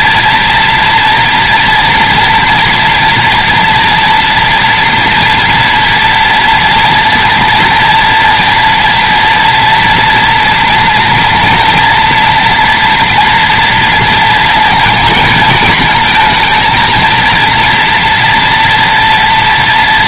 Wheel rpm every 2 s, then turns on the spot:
230, 230, 230, 230, 240, 230, 240, 230, 220, 230.
none